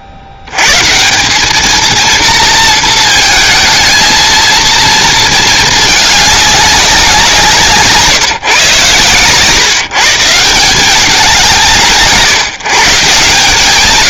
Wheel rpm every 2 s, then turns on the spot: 60, 230, 220, 200, 140, 150, 120.
none